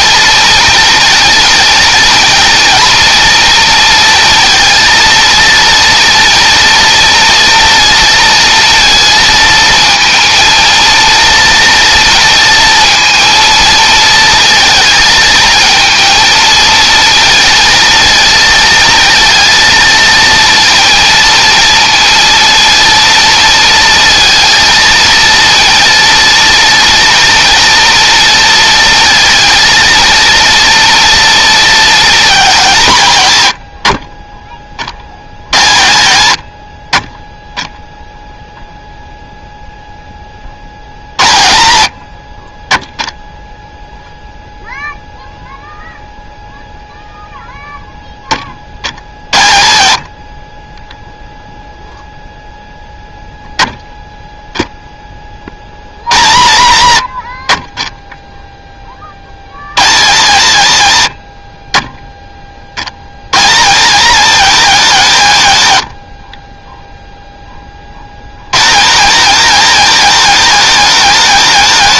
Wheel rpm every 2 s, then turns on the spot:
230, 230, 230, 230, 230, 230, 230, 220, 230, 230, 230, 230, 230, 230, 230, 230, 200, 30, 80, 0, 50, 20, 0, 0, 40, 40, 0, 0, 110, 10, 140, 40, 210, 20, 130, 220.
none